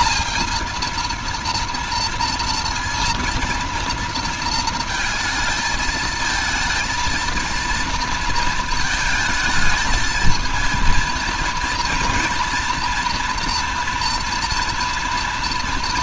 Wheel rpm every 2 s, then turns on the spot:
230, 230, 220, 230, 220, 230, 230, 230.
none